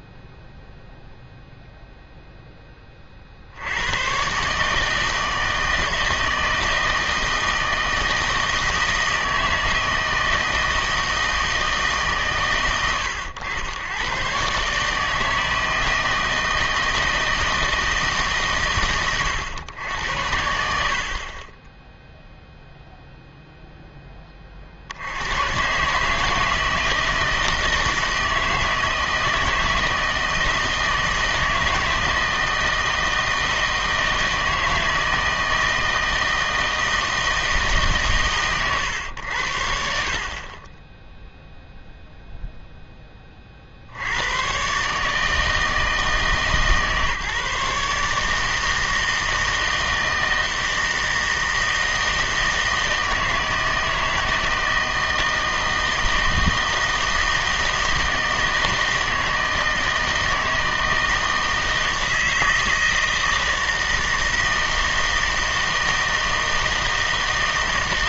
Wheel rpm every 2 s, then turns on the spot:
0, 20, 150, 160, 160, 160, 100, 140, 160, 130, 70, 0, 60, 160, 160, 160, 160, 160, 160, 110, 20, 0, 130, 150, 160, 160, 160, 160, 160, 160, 160, 160, 160, 160.
none